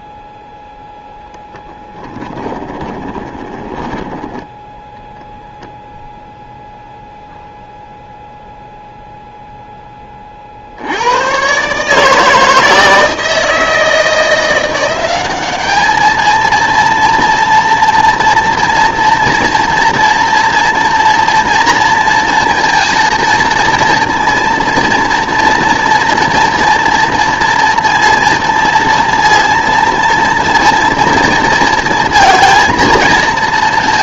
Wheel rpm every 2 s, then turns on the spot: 0, 10, 0, 0, 0, 50, 160, 180, 230, 230, 230, 230, 230, 230, 230, 230, 230.
2-4